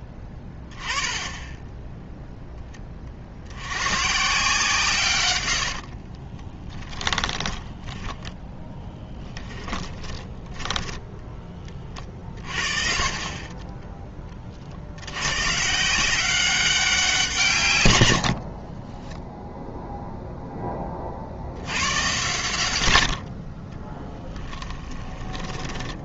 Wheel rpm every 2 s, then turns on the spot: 20, 10, 140, 20, 10, 30, 40, 60, 190, 40, 10, 100, 10.
6-12 18-20 24-26